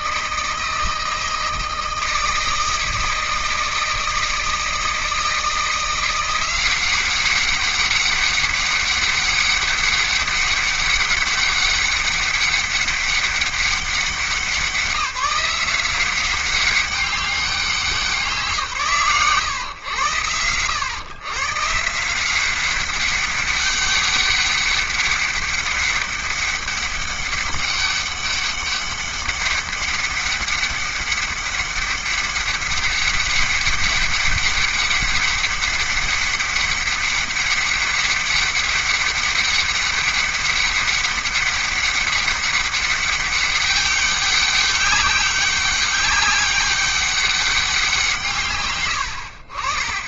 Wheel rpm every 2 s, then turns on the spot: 160, 160, 160, 190, 200, 200, 200, 180, 190, 140, 120, 190, 200, 200, 200, 200, 200, 200, 200, 200, 200, 200, 190, 190, 120.
none